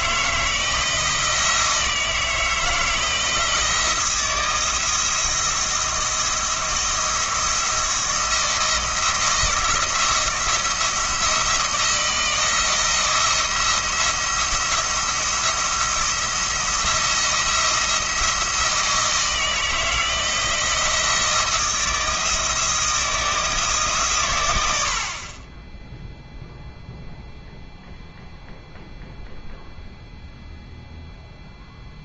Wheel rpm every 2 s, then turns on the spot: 160, 160, 170, 170, 170, 170, 160, 170, 170, 170, 170, 160, 100, 0, 0, 0.
none